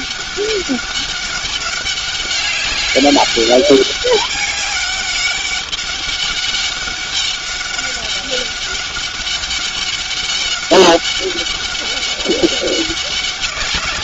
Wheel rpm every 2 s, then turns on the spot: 200, 200, 200, 200, 200, 200, 190.
none